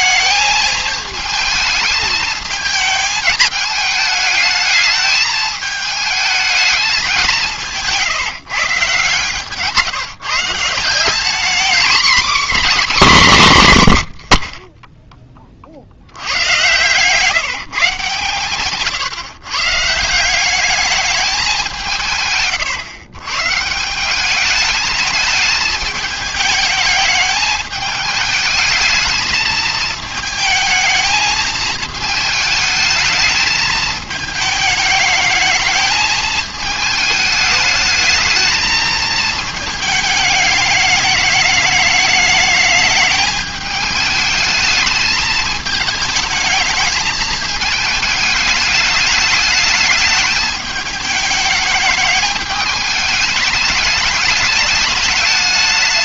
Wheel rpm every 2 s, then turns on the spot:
220, 220, 210, 210, 160, 170, 250, 30, 120, 130, 200, 130, 210, 210, 220, 220, 220, 210, 220, 220, 210, 210, 220, 220, 210, 210, 210, 210.
none